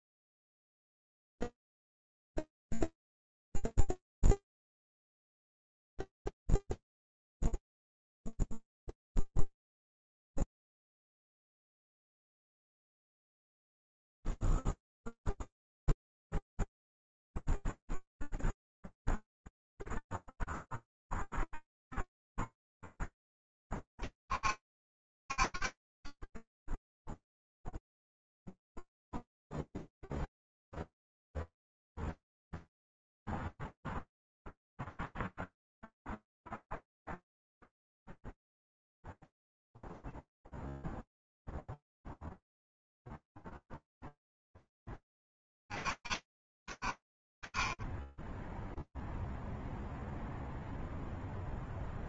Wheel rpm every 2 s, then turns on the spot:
0, 0, 0, 0, 0, 0, 0, 0, 0, 0, 0, 0, 40, 10, 0, 0, 0, 0, 0, 0, 0, 0, 0, 50, 0, 0.
none